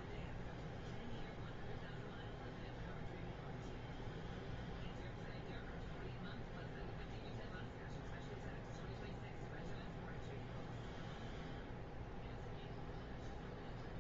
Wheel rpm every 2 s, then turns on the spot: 0, 0, 0, 0, 0, 0, 0.
none